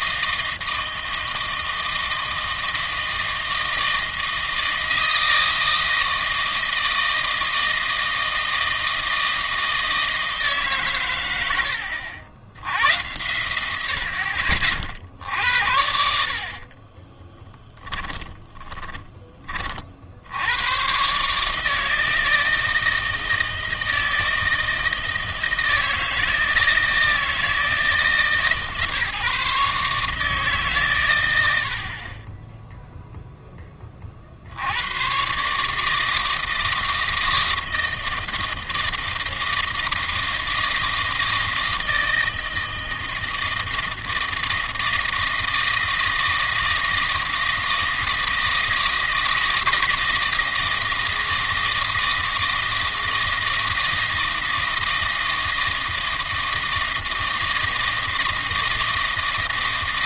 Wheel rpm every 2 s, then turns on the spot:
160, 160, 160, 160, 160, 130, 90, 60, 40, 20, 120, 160, 160, 160, 150, 120, 0, 100, 160, 160, 160, 160, 160, 160, 160, 160, 160, 160, 160, 160.
16-18